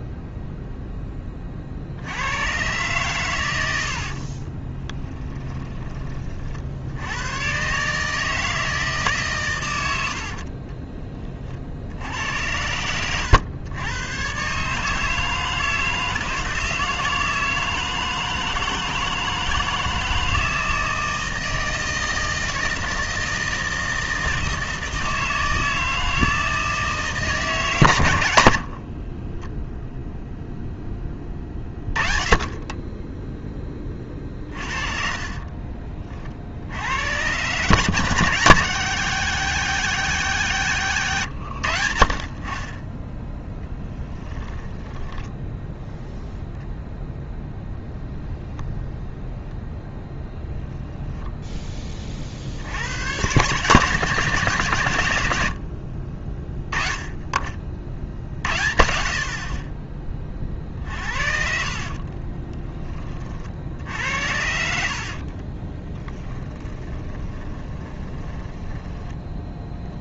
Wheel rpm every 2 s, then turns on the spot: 0, 120, 20, 70, 160, 40, 100, 150, 160, 160, 160, 160, 160, 160, 60, 10, 10, 40, 70, 150, 140, 30, 10, 0, 0, 0, 90, 130, 10, 70, 40, 20, 60, 20, 10.
4-6 10-12 28-30 34-36 40-42 44-46 60-62 64-70